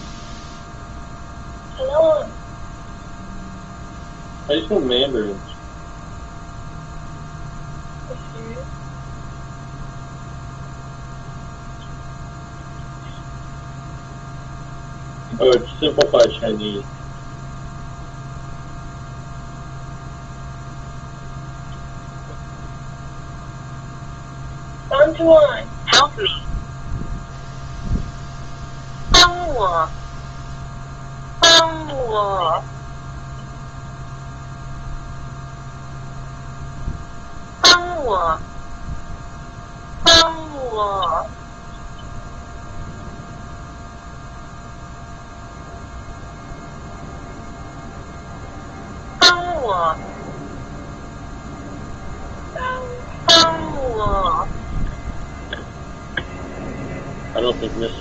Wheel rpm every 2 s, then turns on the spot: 0, 0, 0, 0, 0, 0, 0, 0, 0, 0, 0, 0, 0, 0, 0, 0, 0, 0, 0, 0, 0, 0, 0, 0, 0, 0, 0, 0, 0.
none